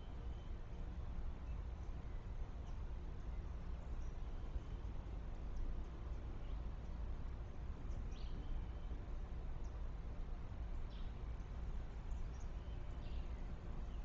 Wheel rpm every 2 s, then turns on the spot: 0, 0, 0, 0, 0, 0, 0.
none